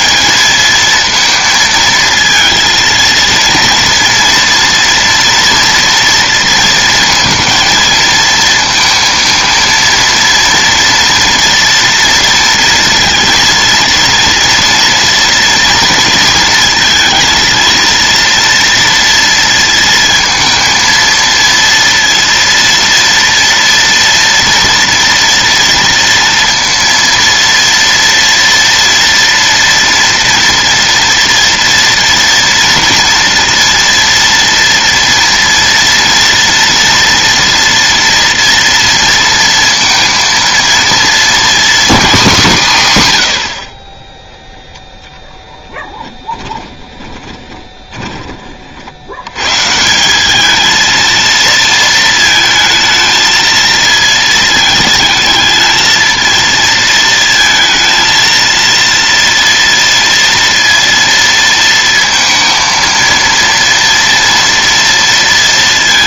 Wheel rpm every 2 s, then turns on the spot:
150, 230, 230, 230, 220, 230, 230, 230, 230, 230, 230, 230, 230, 230, 230, 230, 230, 240, 230, 230, 230, 230, 20, 10, 40, 210, 220, 220, 230, 230, 230, 230, 230.
46-48